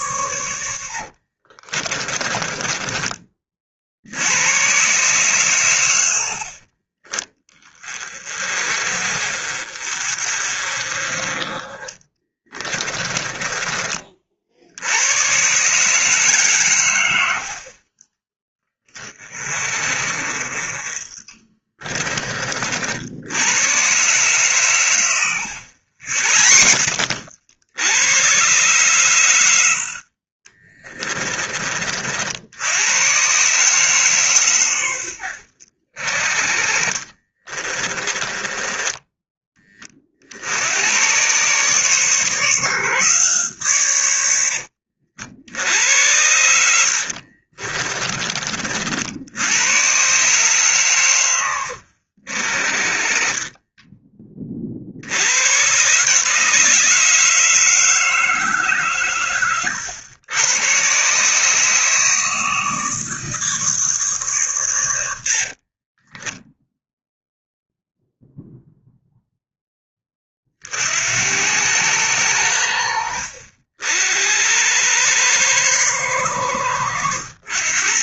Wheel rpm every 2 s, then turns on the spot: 90, 20, 110, 40, 40, 40, 20, 50, 140, 20, 30, 40, 120, 90, 120, 30, 80, 130, 40, 20, 70, 150, 90, 80, 40, 130, 50, 30, 150, 150, 110, 150, 130, 0, 0, 40, 90, 90, 110.
2-4 12-14 30-32 36-40 44-46